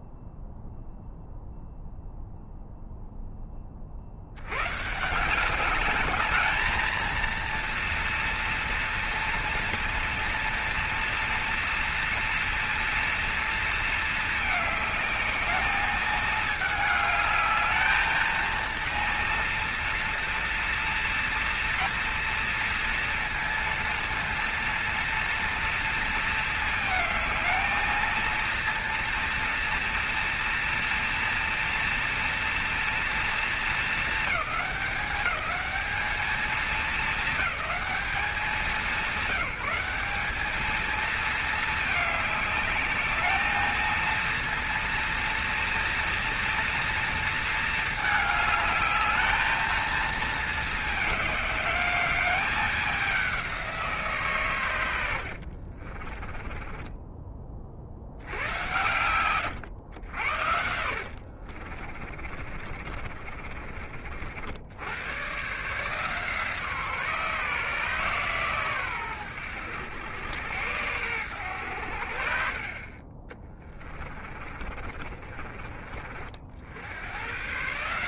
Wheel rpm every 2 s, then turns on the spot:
0, 0, 140, 220, 230, 230, 230, 210, 210, 230, 230, 230, 230, 220, 230, 230, 230, 200, 220, 200, 220, 210, 230, 230, 210, 210, 190, 100, 20, 120, 70, 40, 100, 150, 120, 100, 30, 30, 90.
56-58 60-64 74-76